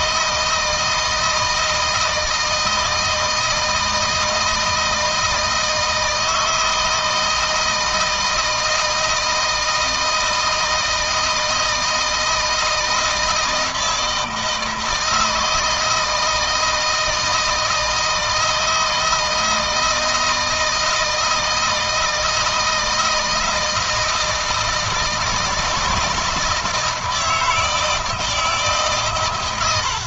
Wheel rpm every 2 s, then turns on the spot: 160, 160, 160, 160, 160, 160, 160, 160, 160, 160, 160, 160, 160, 160, 130.
none